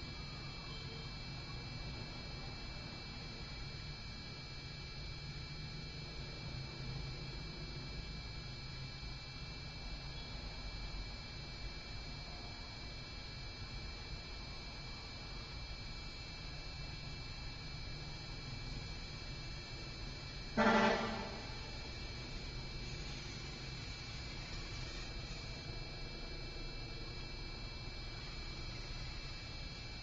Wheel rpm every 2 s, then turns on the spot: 0, 0, 0, 0, 0, 0, 0, 0, 0, 0, 0, 0, 0, 0, 0.
none